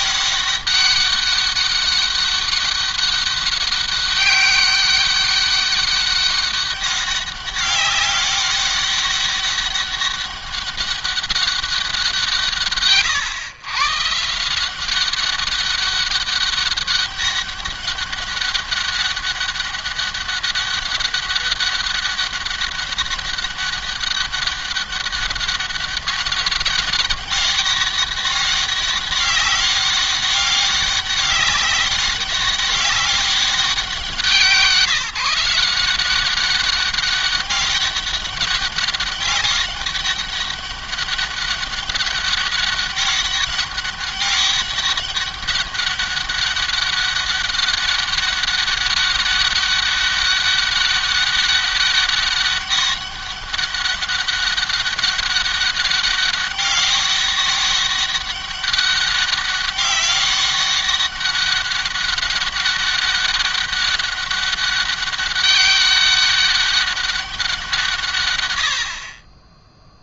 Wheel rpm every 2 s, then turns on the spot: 200, 200, 200, 200, 200, 200, 150, 170, 200, 200, 200, 200, 200, 200, 200, 200, 200, 170, 190, 200, 200, 200, 200, 200, 190, 200, 200, 200, 200, 200, 200, 200, 200, 200, 100.
none